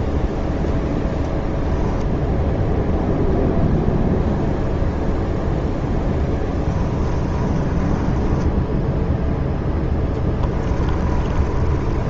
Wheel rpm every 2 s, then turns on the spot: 10, 0, 0, 20, 10, 20.
6-12